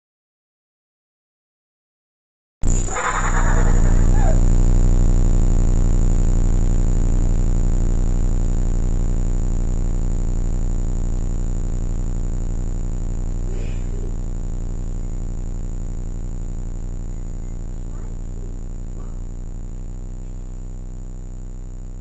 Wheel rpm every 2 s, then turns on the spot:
0, 0, 0, 0, 0, 0, 0, 0, 0, 0, 0.
none